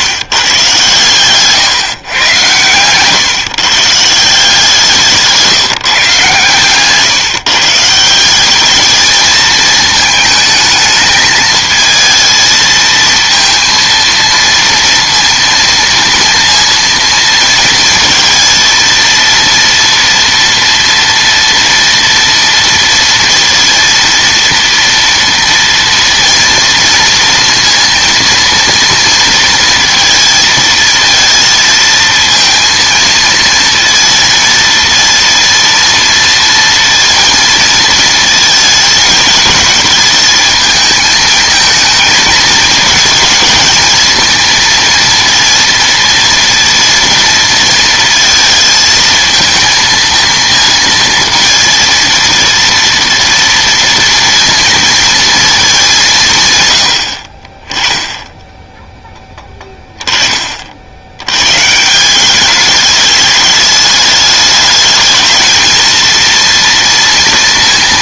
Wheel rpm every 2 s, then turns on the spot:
130, 120, 170, 130, 200, 220, 220, 230, 230, 230, 230, 230, 230, 230, 230, 230, 230, 230, 230, 220, 220, 220, 230, 230, 220, 230, 230, 230, 120, 10, 50, 200, 210, 230.
none